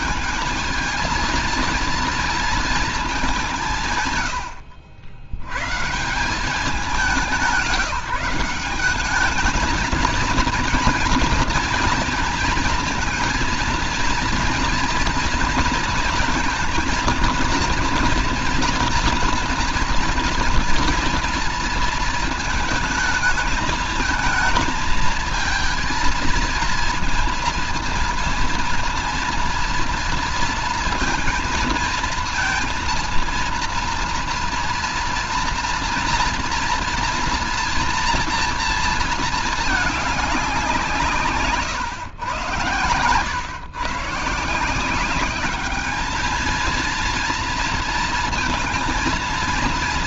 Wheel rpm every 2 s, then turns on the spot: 210, 230, 120, 190, 180, 230, 220, 230, 230, 230, 230, 220, 220, 230, 230, 230, 230, 230, 230, 230, 200, 110, 160, 220, 230.
none